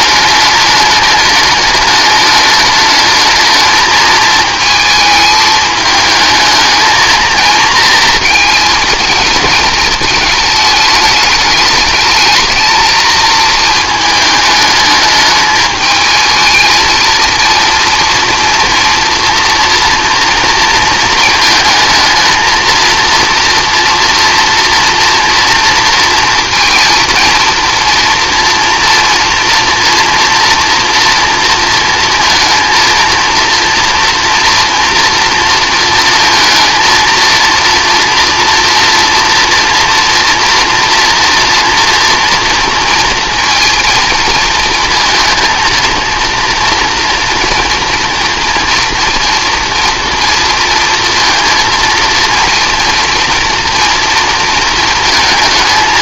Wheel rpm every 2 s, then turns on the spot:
210, 210, 220, 220, 230, 220, 220, 220, 220, 240, 230, 230, 230, 230, 230, 230, 230, 230, 220, 230, 230, 230, 230, 230, 230, 230, 230, 230.
none